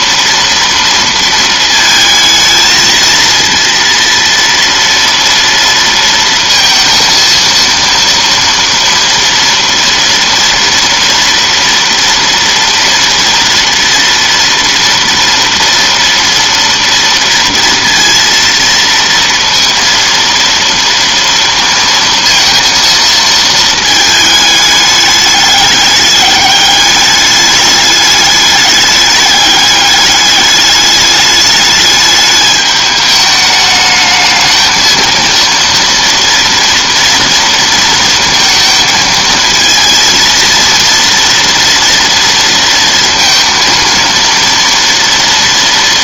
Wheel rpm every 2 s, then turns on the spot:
230, 220, 230, 230, 240, 240, 240, 230, 230, 230, 230, 230, 210, 210, 210, 210, 210, 220, 240, 220, 230, 230, 230.
none